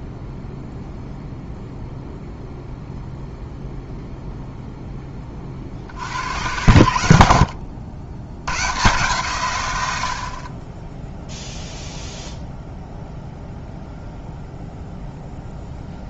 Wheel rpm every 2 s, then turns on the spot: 0, 0, 10, 90, 110, 10, 0, 0.
none